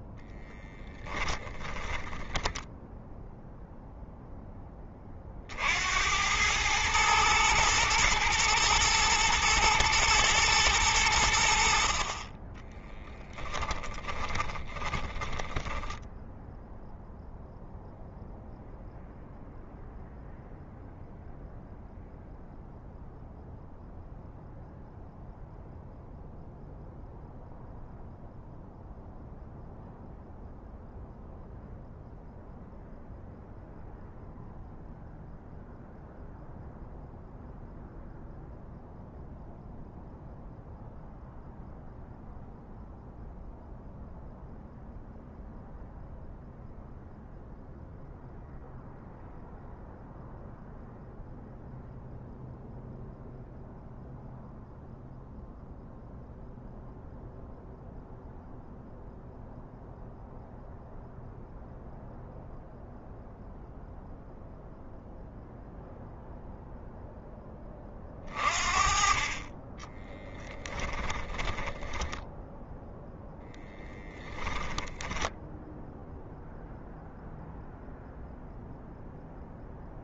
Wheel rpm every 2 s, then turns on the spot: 20, 0, 20, 110, 110, 100, 20, 10, 0, 0, 0, 0, 0, 0, 0, 0, 0, 0, 0, 0, 0, 0, 0, 0, 0, 0, 0, 0, 0, 0, 0, 0, 0, 0, 40, 10, 10, 10, 0, 0.
0-2 12-16 70-72